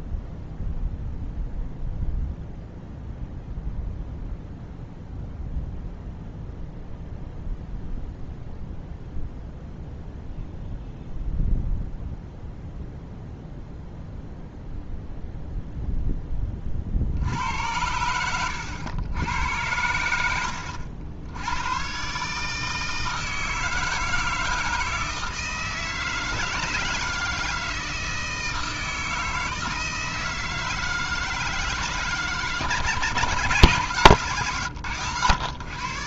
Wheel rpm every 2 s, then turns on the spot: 0, 0, 0, 0, 0, 0, 0, 0, 30, 100, 80, 160, 160, 160, 160, 160, 140, 130.
none